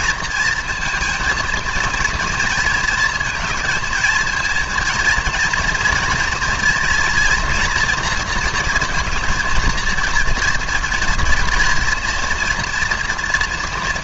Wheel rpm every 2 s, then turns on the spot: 230, 230, 230, 240, 230, 230, 230.
none